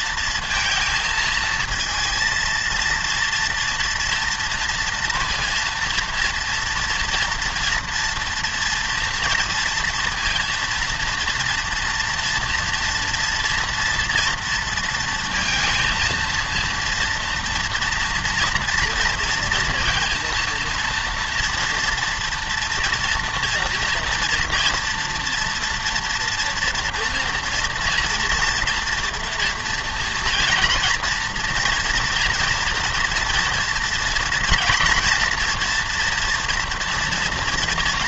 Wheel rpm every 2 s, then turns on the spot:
230, 230, 230, 230, 240, 230, 230, 230, 230, 230, 230, 230, 230, 230, 230, 230, 230, 230, 240.
none